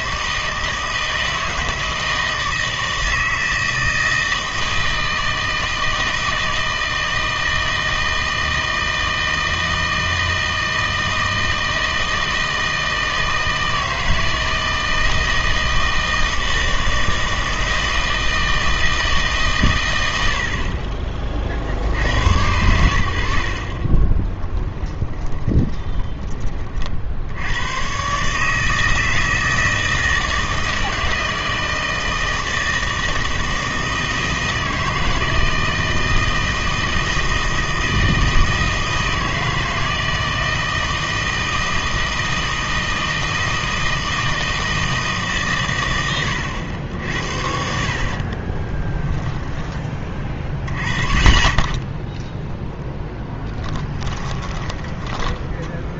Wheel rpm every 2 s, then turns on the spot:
160, 160, 160, 160, 160, 160, 160, 160, 160, 160, 50, 80, 10, 30, 160, 160, 160, 160, 160, 160, 160, 160, 160, 90, 20, 20, 0, 10.
24-26 48-50 54-56